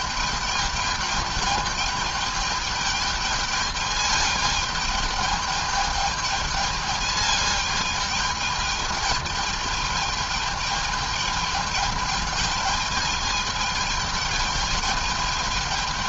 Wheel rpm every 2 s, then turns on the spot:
220, 210, 210, 220, 210, 210, 210, 220.
none